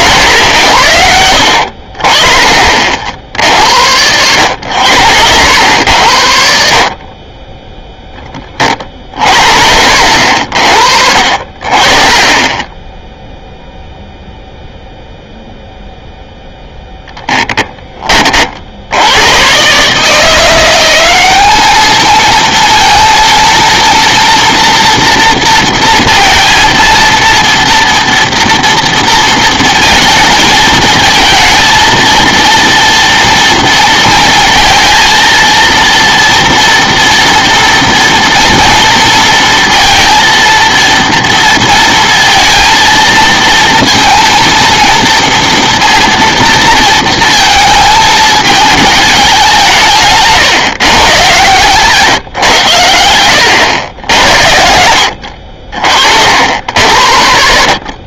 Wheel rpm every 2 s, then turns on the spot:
90, 50, 90, 50, 30, 60, 10, 0, 0, 70, 180, 230, 230, 230, 230, 220, 230, 230, 230, 230, 230, 230, 230, 230, 210, 150, 110, 70, 80.
none